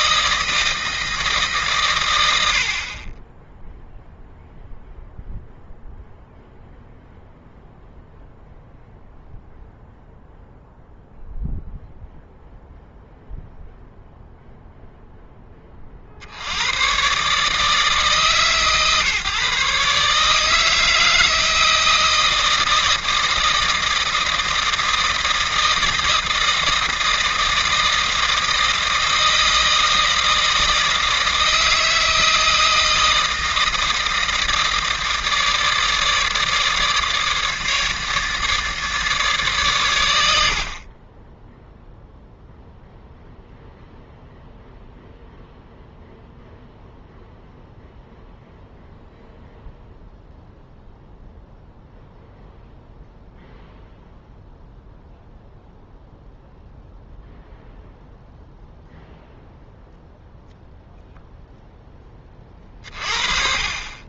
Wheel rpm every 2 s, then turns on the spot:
160, 60, 0, 0, 0, 0, 0, 0, 110, 140, 160, 160, 160, 160, 160, 160, 160, 160, 150, 150, 50, 0, 0, 0, 0, 0, 0, 0, 0, 0, 0, 40.
none